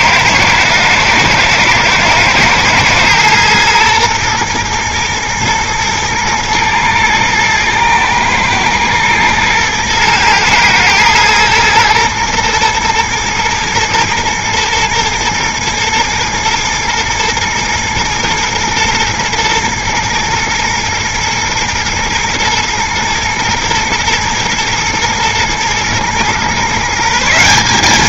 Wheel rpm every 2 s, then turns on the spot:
110, 110, 120, 120, 110, 110, 120, 120, 110, 120, 120, 120, 110, 120.
none